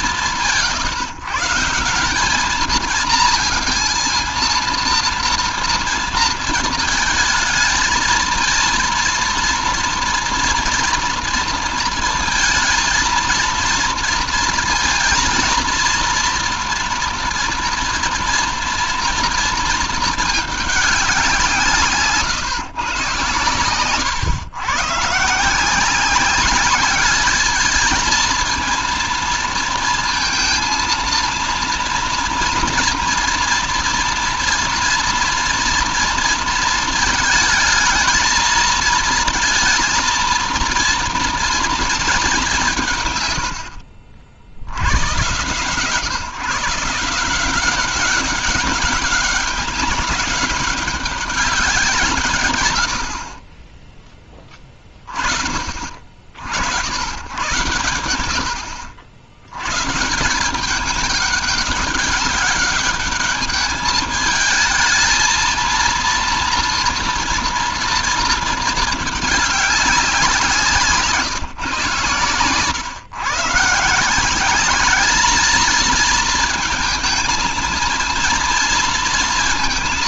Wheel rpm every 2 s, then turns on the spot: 150, 220, 230, 220, 230, 230, 230, 220, 230, 230, 180, 130, 140, 210, 230, 230, 230, 240, 220, 230, 230, 120, 110, 170, 200, 200, 60, 40, 90, 70, 200, 210, 220, 230, 220, 160, 130, 210, 220, 230.
none